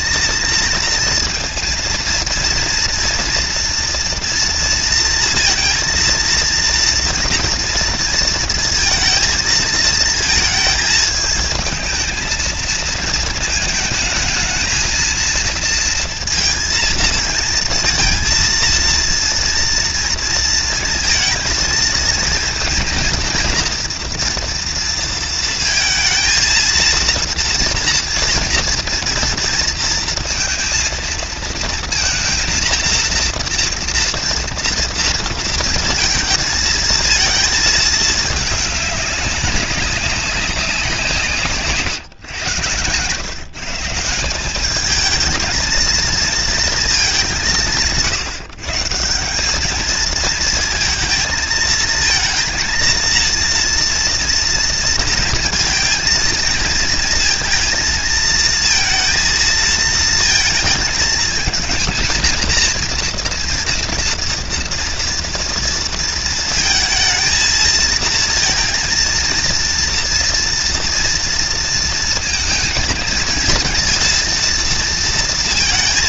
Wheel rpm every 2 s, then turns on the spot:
230, 230, 230, 230, 230, 220, 220, 220, 230, 230, 230, 230, 240, 230, 230, 230, 230, 230, 220, 210, 190, 120, 180, 230, 140, 220, 230, 230, 220, 230, 220, 230, 230, 230, 230, 230, 230, 230.
none